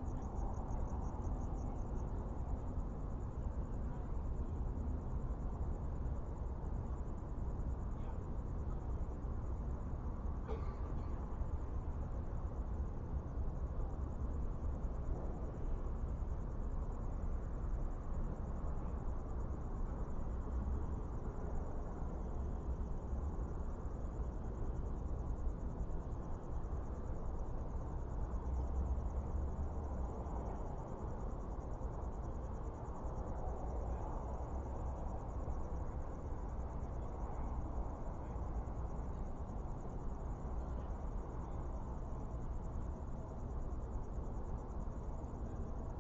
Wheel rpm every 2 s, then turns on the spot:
0, 0, 0, 0, 0, 0, 0, 0, 0, 0, 0, 0, 0, 0, 0, 0, 0, 0, 0, 0, 0, 0, 0.
none